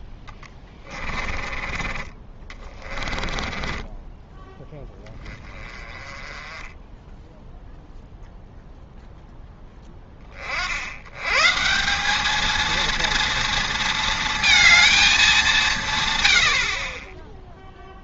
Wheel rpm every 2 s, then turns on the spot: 10, 30, 10, 10, 0, 60, 220, 230, 50.
0-4